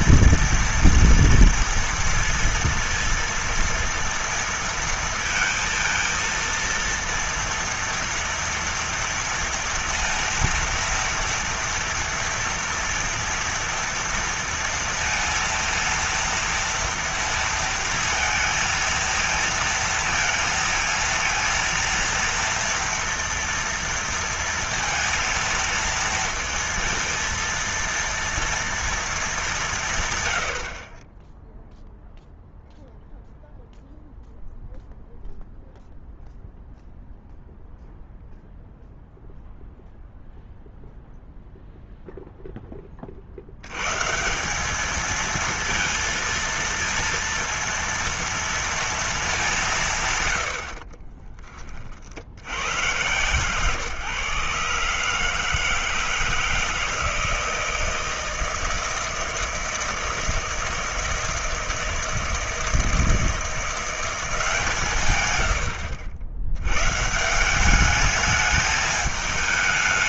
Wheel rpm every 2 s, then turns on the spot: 230, 230, 230, 230, 230, 230, 230, 230, 230, 230, 230, 230, 230, 230, 230, 70, 0, 0, 0, 0, 0, 10, 190, 230, 230, 70, 100, 150, 160, 160, 160, 160, 170, 100, 210.
none